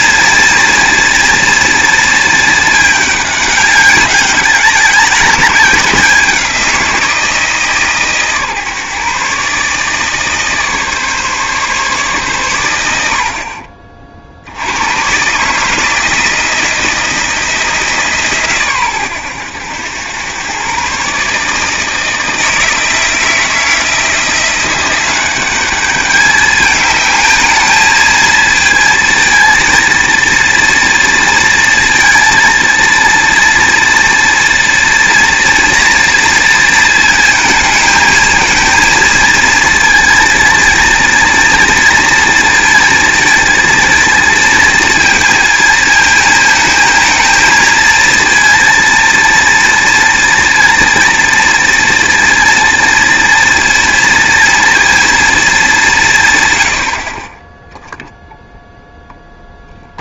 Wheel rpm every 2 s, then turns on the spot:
230, 210, 190, 170, 140, 150, 90, 90, 170, 120, 130, 160, 180, 210, 230, 230, 230, 230, 230, 230, 230, 230, 230, 220, 230, 230, 230, 230, 90, 0.
none